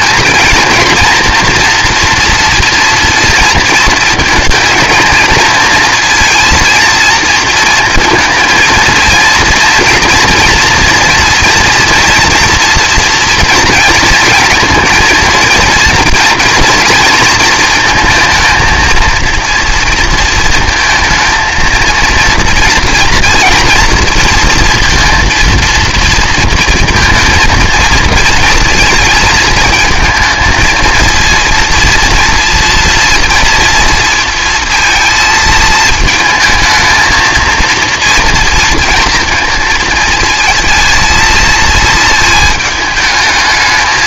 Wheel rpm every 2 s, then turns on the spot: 230, 230, 230, 230, 230, 230, 230, 230, 230, 230, 230, 230, 230, 230, 220, 220, 230, 230, 220, 230, 230, 220.
none